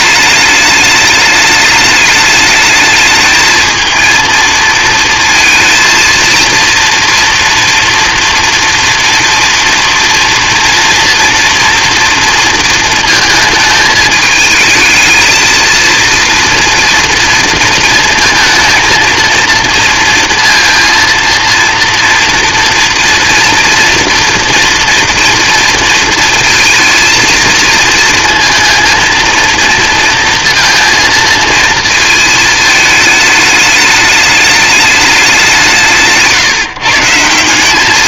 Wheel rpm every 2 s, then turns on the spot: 210, 210, 230, 230, 230, 230, 230, 220, 240, 230, 230, 230, 230, 230, 230, 230, 220, 210, 150.
none